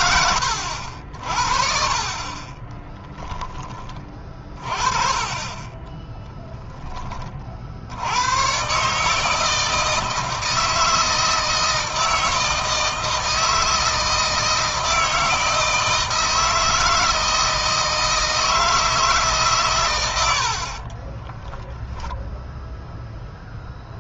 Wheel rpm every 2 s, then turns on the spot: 70, 20, 30, 10, 140, 160, 160, 160, 160, 160, 30, 10.
2-4 20-22